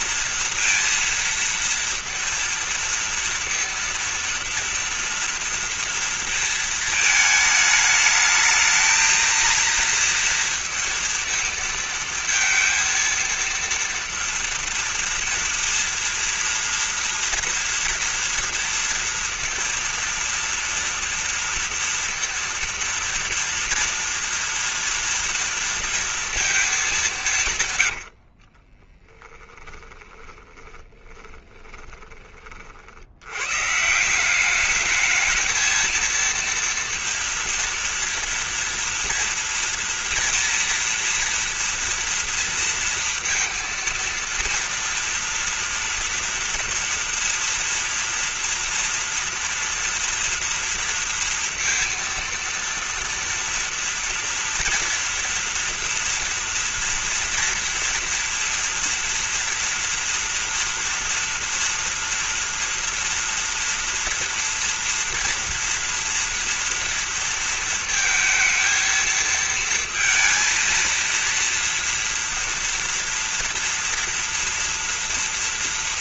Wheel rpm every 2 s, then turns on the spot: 230, 230, 230, 220, 220, 230, 220, 230, 230, 230, 230, 230, 230, 220, 30, 20, 50, 200, 230, 230, 230, 230, 230, 230, 240, 230, 230, 230, 230, 230, 240, 230, 240, 230, 220, 230, 230, 230.
28-32